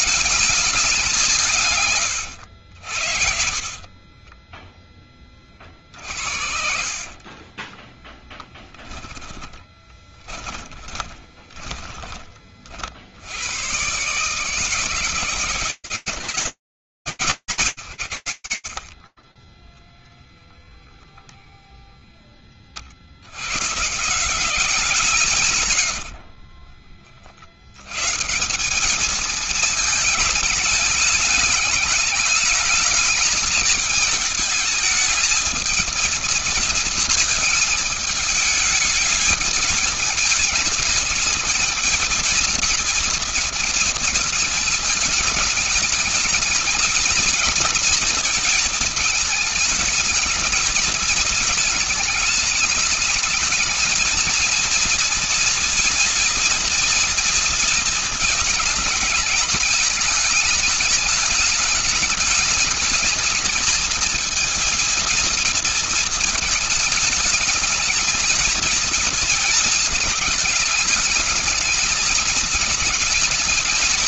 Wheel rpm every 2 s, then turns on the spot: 210, 110, 30, 60, 10, 10, 20, 140, 180, 120, 0, 10, 160, 70, 160, 210, 210, 210, 230, 220, 220, 230, 220, 220, 220, 220, 210, 230, 230, 220, 220, 220, 230, 220, 220, 220, 220.
2-12 26-28